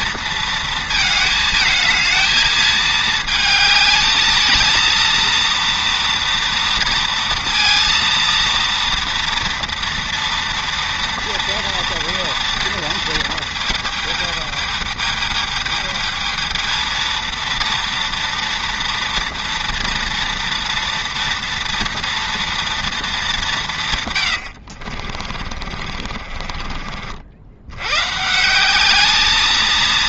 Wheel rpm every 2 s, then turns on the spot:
220, 220, 220, 230, 230, 230, 230, 220, 220, 230, 230, 230, 70, 40, 180.
24-26